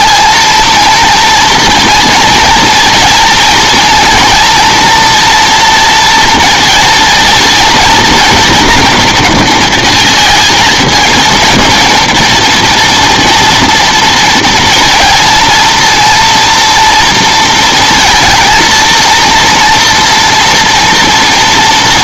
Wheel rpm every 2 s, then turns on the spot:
230, 230, 230, 230, 230, 220, 230, 230, 230, 230, 240.
none